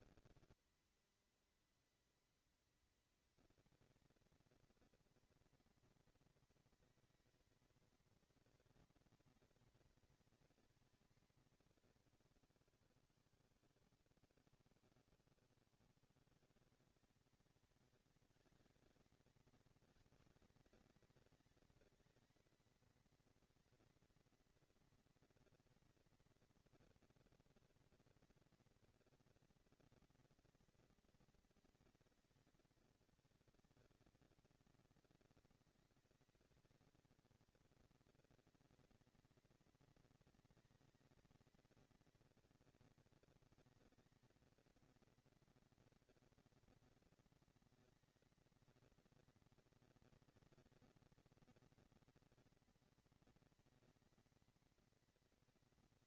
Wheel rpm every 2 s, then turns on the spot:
230, 230, 230, 230, 220, 220, 190, 100, 150, 210, 210, 220, 230, 230, 230, 230, 220, 200, 200, 220, 230, 230, 230, 230, 230, 230, 230, 230.
none